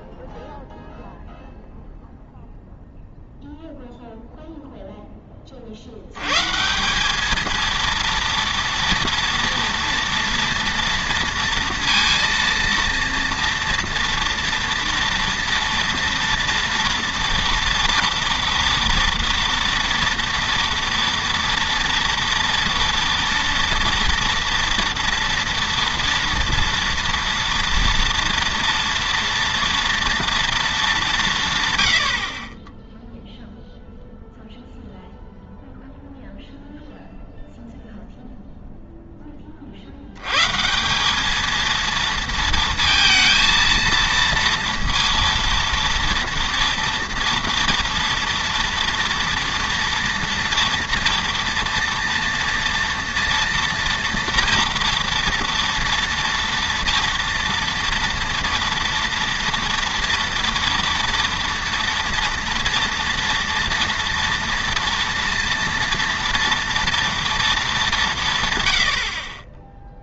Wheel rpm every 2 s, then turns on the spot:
0, 0, 0, 160, 230, 230, 230, 230, 230, 230, 230, 230, 240, 230, 230, 230, 10, 0, 0, 0, 160, 230, 230, 230, 230, 230, 230, 230, 230, 230, 230, 230, 230, 230, 110.
none